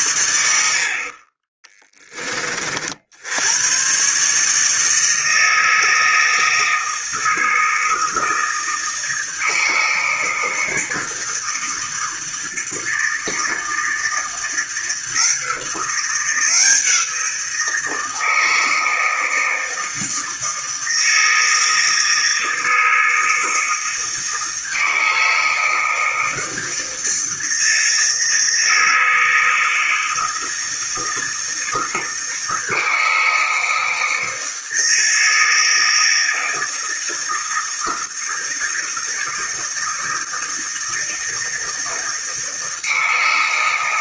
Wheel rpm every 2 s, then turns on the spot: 70, 50, 150, 160, 160, 160, 160, 160, 170, 160, 160, 160, 160, 160, 160, 160, 160, 160, 160, 160, 160, 160.
none